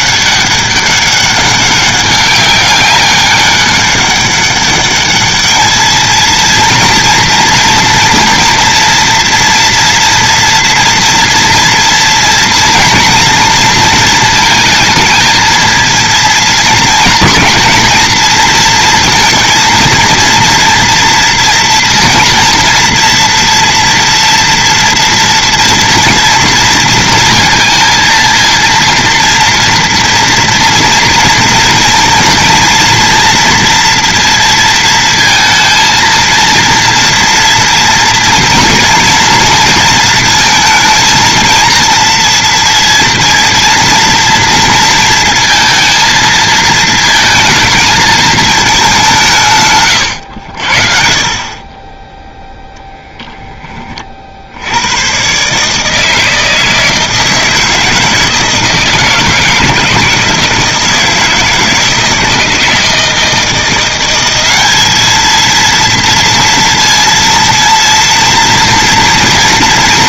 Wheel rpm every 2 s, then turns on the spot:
200, 200, 200, 230, 230, 230, 230, 220, 220, 230, 230, 230, 230, 230, 230, 230, 230, 230, 230, 230, 230, 230, 230, 220, 190, 50, 10, 100, 160, 170, 160, 160, 210, 230, 230.
none